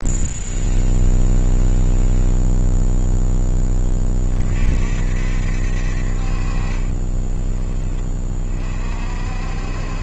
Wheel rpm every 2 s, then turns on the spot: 0, 0, 40, 40, 40.
none